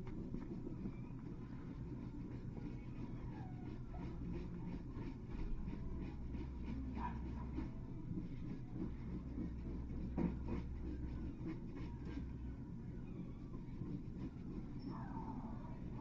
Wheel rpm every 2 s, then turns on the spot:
0, 0, 0, 0, 0, 0, 0, 0.
none